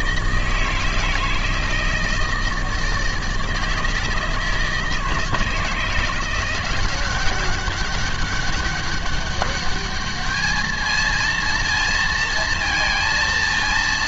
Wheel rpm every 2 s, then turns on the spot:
160, 160, 160, 180, 200, 220, 230.
none